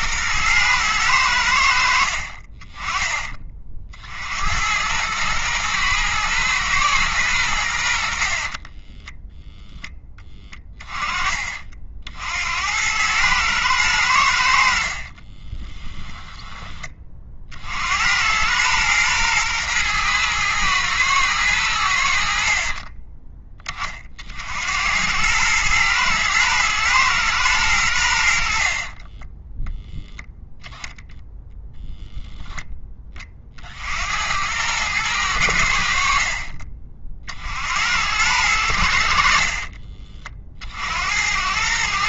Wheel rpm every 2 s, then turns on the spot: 110, 30, 100, 120, 20, 20, 90, 60, 30, 120, 110, 30, 90, 110, 30, 0, 10, 100, 30, 70, 70.
8-10 14-16 22-24 28-30